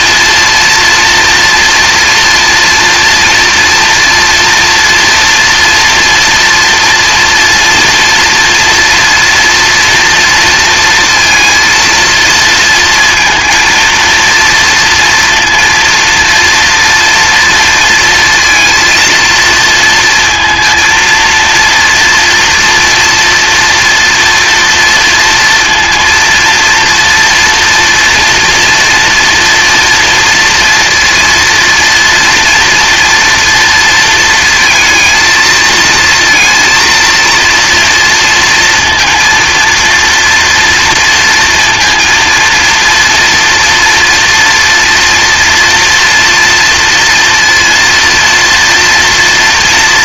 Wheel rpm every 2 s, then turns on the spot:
230, 230, 230, 230, 240, 230, 230, 230, 230, 230, 230, 230, 230, 240, 230, 230, 230, 230, 230, 230, 230, 230, 240, 230, 230.
none